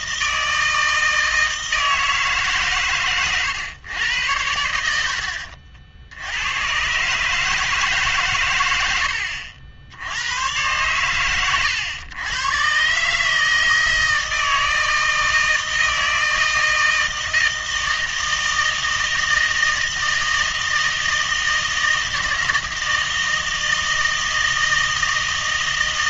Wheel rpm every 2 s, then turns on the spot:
160, 130, 80, 110, 100, 110, 120, 160, 160, 160, 160, 160, 160.
none